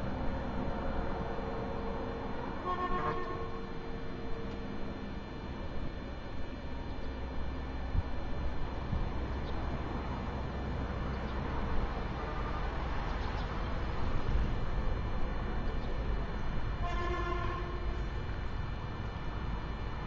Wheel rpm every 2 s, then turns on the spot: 0, 0, 0, 0, 0, 0, 0, 0, 0, 0.
none